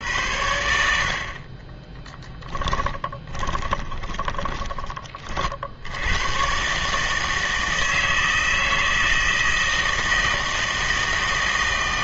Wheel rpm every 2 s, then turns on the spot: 70, 20, 20, 140, 160, 160.
2-4